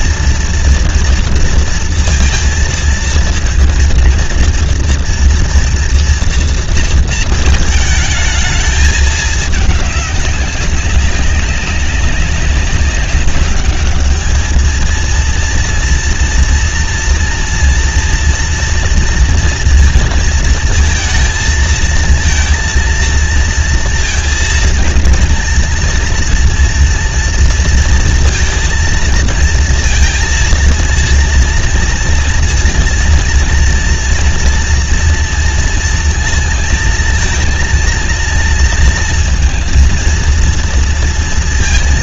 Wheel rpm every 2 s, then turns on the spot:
230, 230, 230, 230, 220, 200, 190, 210, 230, 230, 230, 230, 230, 230, 230, 230, 230, 240, 230, 230, 230.
none